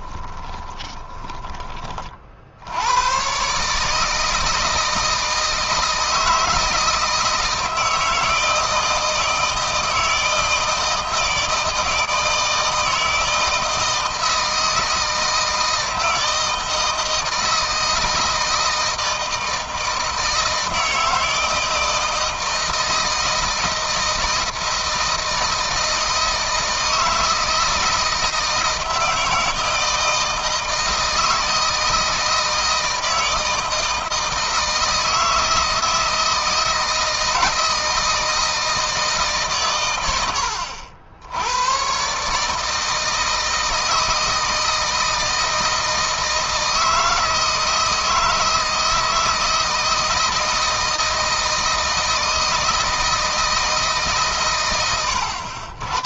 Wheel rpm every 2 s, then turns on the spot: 10, 100, 160, 160, 160, 160, 160, 160, 160, 160, 160, 160, 160, 160, 170, 160, 160, 160, 160, 160, 80, 160, 160, 160, 160, 160, 160, 100.
0-2